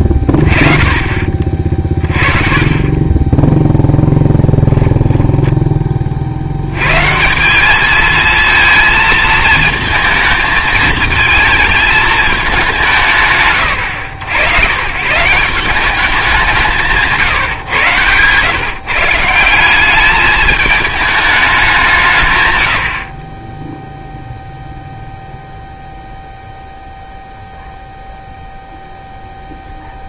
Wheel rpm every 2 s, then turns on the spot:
20, 20, 0, 90, 230, 220, 190, 110, 180, 150, 210, 110, 0, 0, 0.
0-2